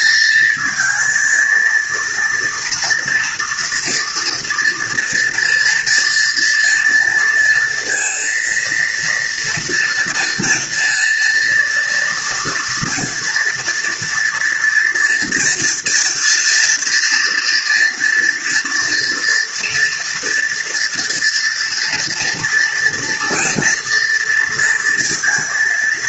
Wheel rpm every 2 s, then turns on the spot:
220, 230, 230, 230, 230, 240, 230, 230, 230, 230, 240, 230, 230.
none